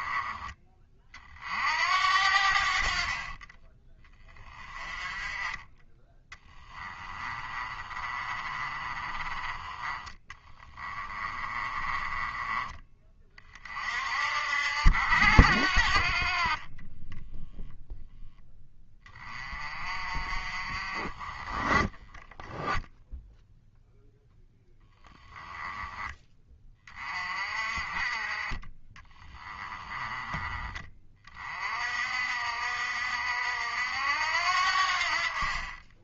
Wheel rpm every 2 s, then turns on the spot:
30, 50, 20, 20, 30, 20, 20, 70, 20, 20, 40, 0, 10, 30, 20, 20, 60, 60.
2-4 6-12 16-18